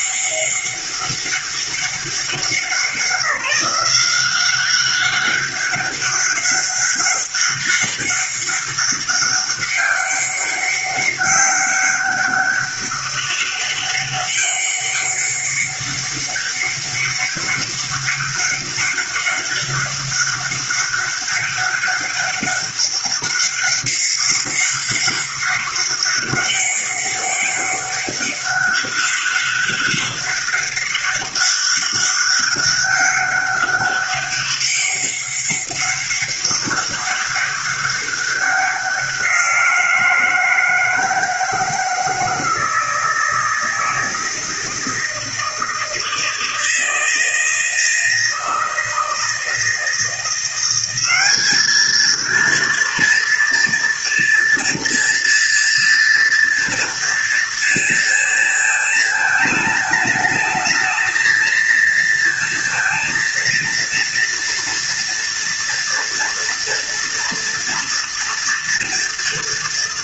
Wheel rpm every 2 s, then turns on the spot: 200, 190, 200, 200, 200, 200, 200, 200, 200, 200, 200, 200, 200, 200, 200, 200, 200, 200, 200, 180, 160, 160, 160, 160, 160, 190, 230, 230, 230, 220, 220, 230, 230, 230, 230.
none